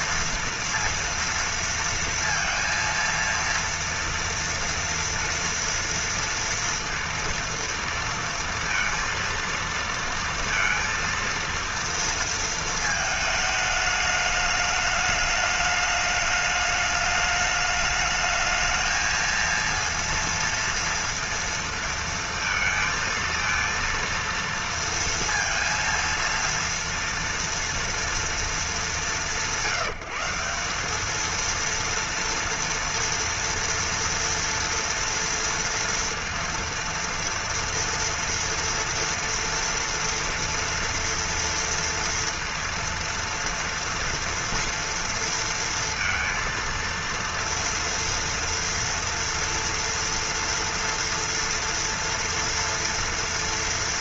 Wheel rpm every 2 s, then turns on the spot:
230, 230, 230, 230, 230, 230, 220, 210, 210, 220, 230, 230, 230, 230, 190, 190, 230, 230, 230, 230, 230, 230, 230, 230, 230, 230, 230.
none